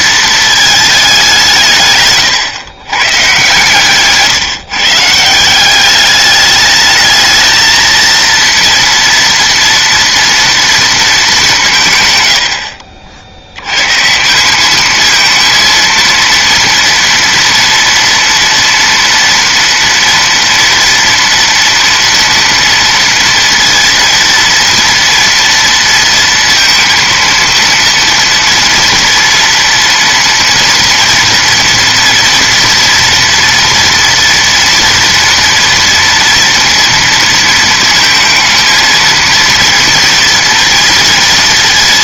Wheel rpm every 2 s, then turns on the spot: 220, 120, 140, 210, 230, 230, 70, 200, 230, 230, 230, 230, 230, 230, 230, 230, 240, 230, 230, 220, 230.
none